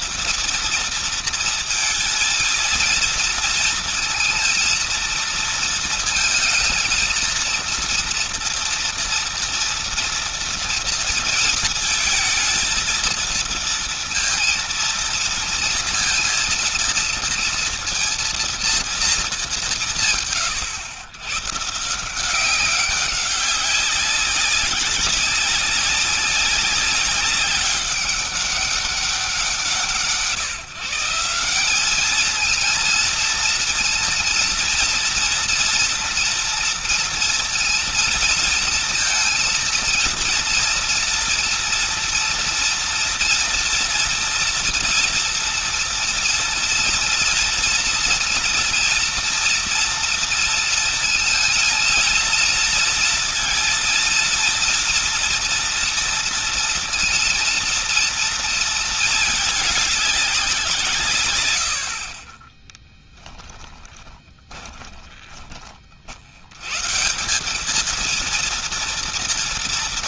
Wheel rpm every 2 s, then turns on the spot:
230, 230, 230, 230, 230, 230, 220, 230, 230, 230, 140, 190, 200, 200, 200, 160, 220, 230, 230, 230, 230, 230, 230, 230, 230, 230, 230, 230, 230, 230, 170, 20, 20, 90, 230.
62-66